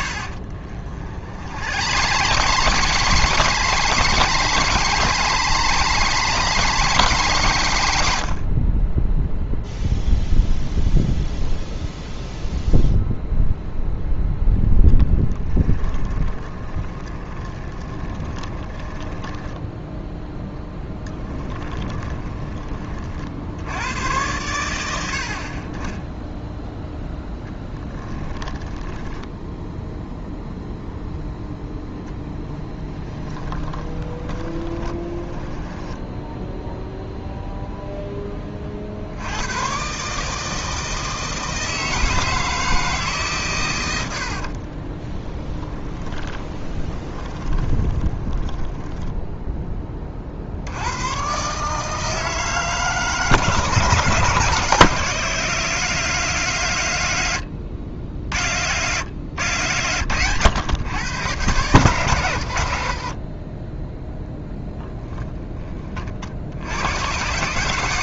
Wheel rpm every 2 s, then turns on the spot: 50, 130, 140, 140, 30, 0, 0, 0, 20, 10, 10, 20, 100, 0, 10, 0, 20, 20, 0, 40, 160, 160, 20, 20, 10, 80, 160, 160, 130, 100, 110, 70, 10, 90.
0-8 16-20 28-30 32-36 44-50